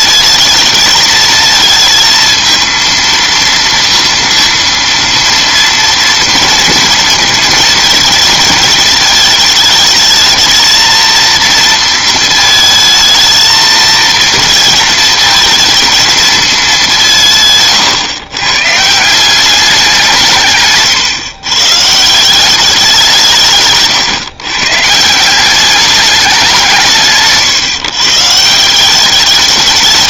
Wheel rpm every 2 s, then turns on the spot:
220, 230, 230, 230, 220, 220, 220, 230, 200, 150, 140, 190, 150, 170, 180.
none